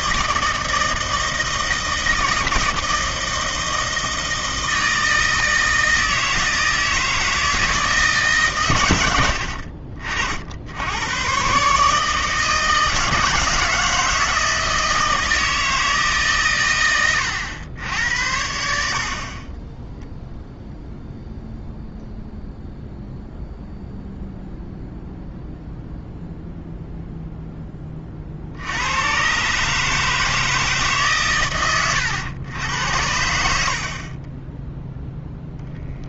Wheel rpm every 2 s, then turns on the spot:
160, 160, 160, 160, 110, 90, 160, 160, 110, 60, 0, 0, 0, 0, 90, 150, 90, 0.
none